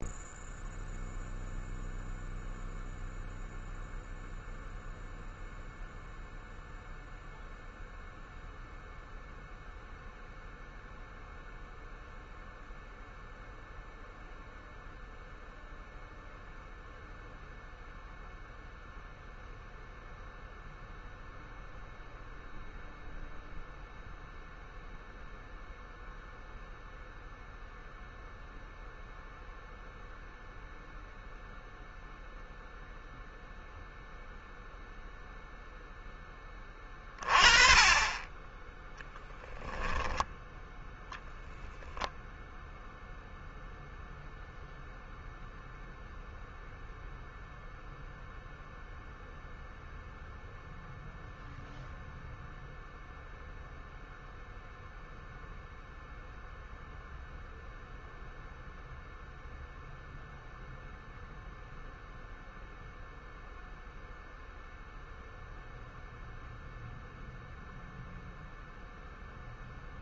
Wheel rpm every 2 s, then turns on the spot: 0, 0, 0, 0, 0, 0, 0, 0, 0, 0, 0, 0, 0, 0, 0, 0, 0, 0, 20, 10, 0, 0, 0, 0, 0, 0, 0, 0, 0, 0, 0, 0, 0, 0, 0.
36-40